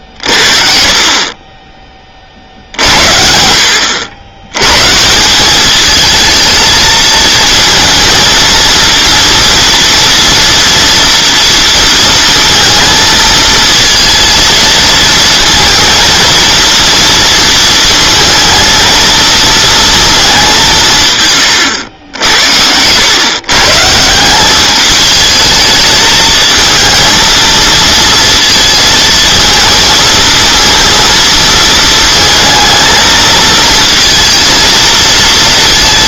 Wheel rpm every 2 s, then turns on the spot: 40, 50, 110, 220, 230, 230, 230, 230, 230, 220, 180, 90, 210, 230, 230, 230, 220, 230.
none